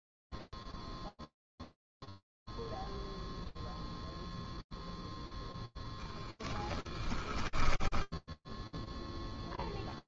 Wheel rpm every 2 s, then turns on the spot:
0, 0, 0, 20, 0.
6-8